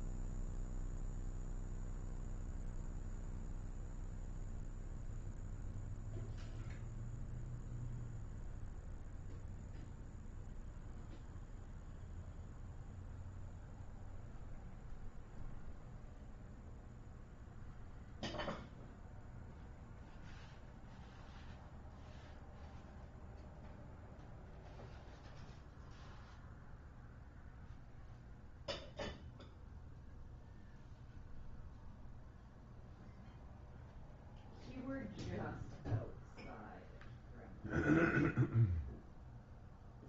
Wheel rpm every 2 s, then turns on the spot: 0, 0, 0, 0, 0, 0, 0, 0, 0, 0, 0, 0, 0, 0, 0, 0, 0, 0, 0, 0.
none